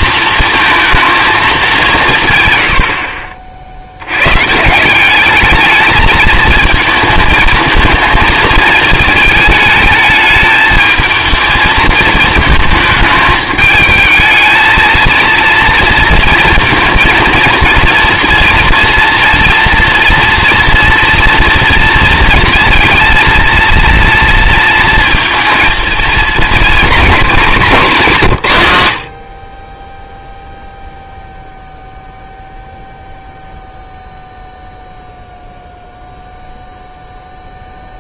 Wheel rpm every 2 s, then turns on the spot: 220, 100, 150, 220, 220, 220, 220, 220, 230, 230, 230, 230, 230, 220, 120, 0, 0, 0, 0.
none